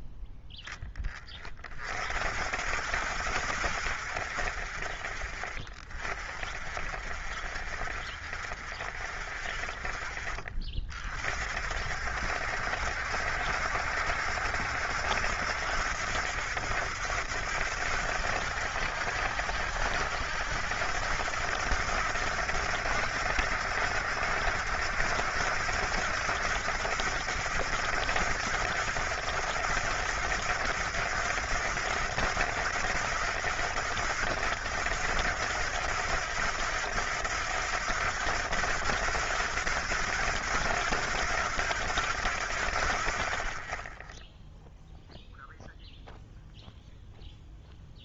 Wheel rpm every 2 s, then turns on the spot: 20, 60, 10, 0, 0, 40, 70, 80, 70, 80, 80, 80, 80, 80, 80, 80, 80, 80, 80, 80, 80, 30, 0, 0.
none